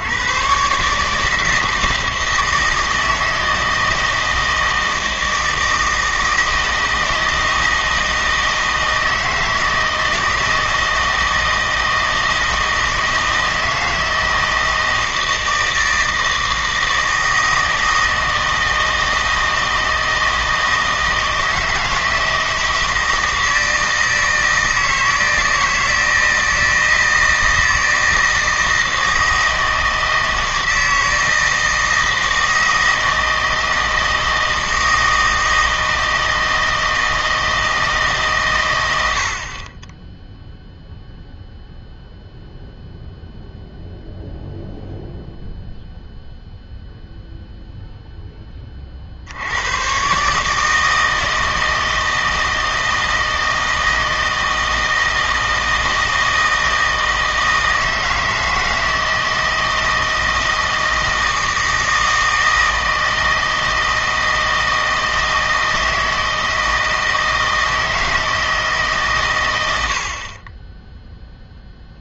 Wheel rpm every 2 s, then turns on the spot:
130, 160, 160, 160, 160, 160, 160, 160, 160, 160, 160, 160, 160, 160, 160, 160, 160, 160, 160, 110, 0, 0, 0, 0, 30, 150, 160, 160, 160, 160, 160, 160, 160, 160, 160, 20.
none